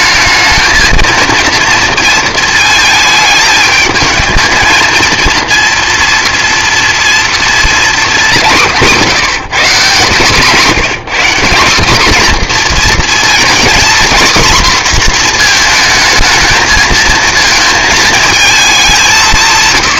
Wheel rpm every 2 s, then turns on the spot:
230, 220, 230, 230, 180, 180, 230, 240, 230, 180.
none